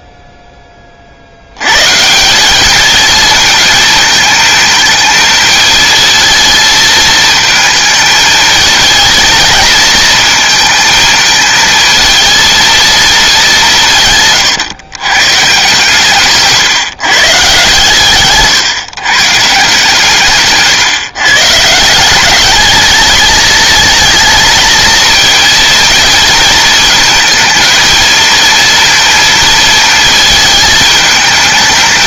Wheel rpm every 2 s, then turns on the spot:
20, 200, 220, 230, 220, 230, 230, 120, 150, 130, 140, 220, 230, 230, 230, 220.
none